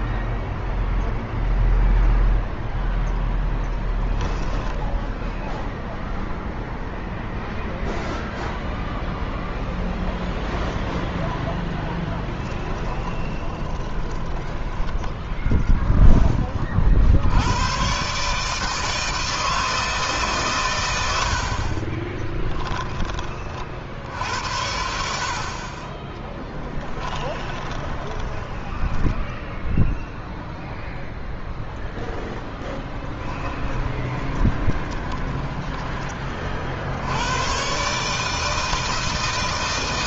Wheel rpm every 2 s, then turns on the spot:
0, 0, 10, 0, 0, 0, 10, 20, 30, 150, 120, 10, 70, 10, 10, 0, 10, 20, 40, 160.
4-6 12-16 22-24 26-30 34-36